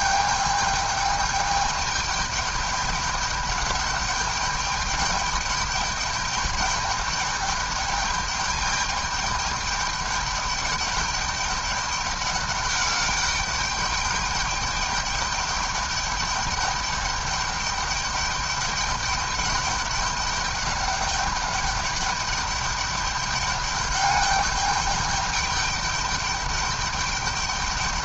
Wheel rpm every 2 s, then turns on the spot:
210, 210, 210, 210, 210, 210, 210, 200, 210, 200, 200, 210, 210, 210.
none